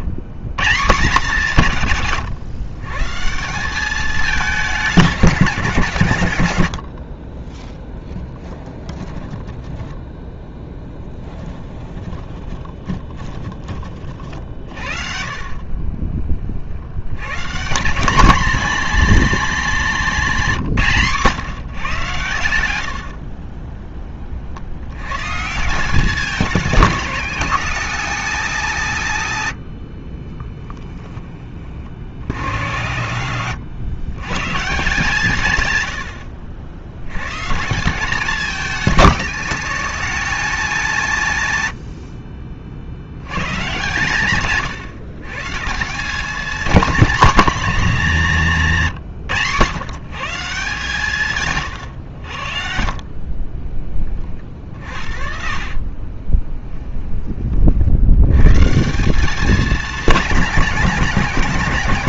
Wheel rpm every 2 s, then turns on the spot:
160, 140, 180, 60, 10, 10, 10, 40, 80, 240, 180, 80, 100, 190, 190, 10, 100, 150, 70, 200, 200, 60, 140, 220, 150, 160, 40, 50, 10, 160, 190.
6-14 54-56